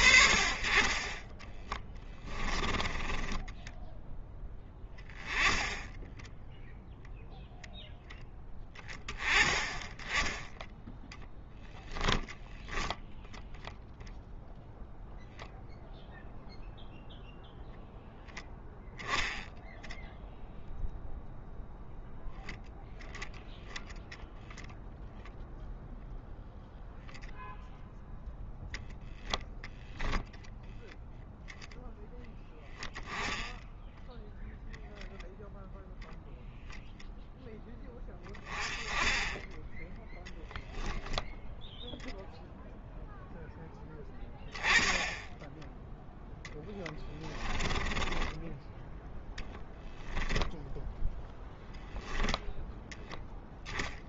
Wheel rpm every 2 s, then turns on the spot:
40, 20, 10, 0, 10, 10, 10, 0, 0, 0, 0, 0, 0, 0, 0, 10, 10, 0, 0, 10, 0, 0, 10, 10, 10, 10, 10.
2-4 46-50